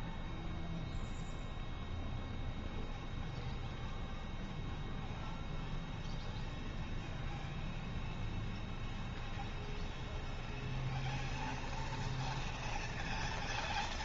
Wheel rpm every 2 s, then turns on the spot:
0, 0, 0, 0, 0, 0, 0.
none